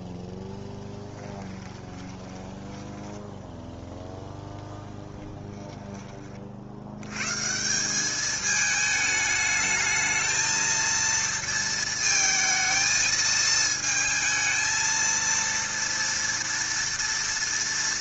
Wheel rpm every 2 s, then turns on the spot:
20, 10, 0, 60, 210, 230, 220, 230, 240.
0-4